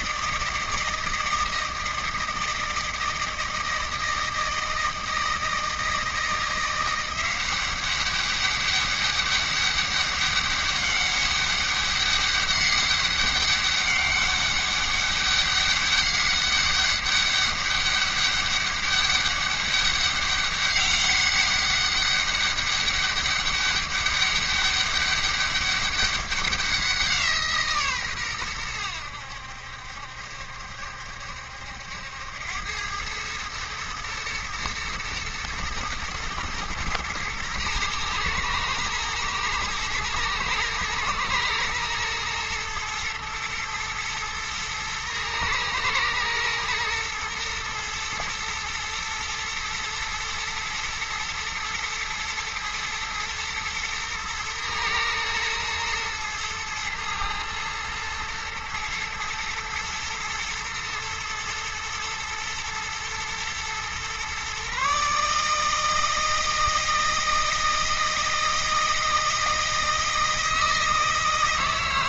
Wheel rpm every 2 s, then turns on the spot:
160, 160, 160, 170, 200, 200, 200, 200, 200, 200, 200, 200, 200, 180, 100, 70, 100, 120, 110, 110, 110, 110, 110, 120, 120, 120, 110, 110, 110, 120, 110, 110, 140, 160, 160, 160.
none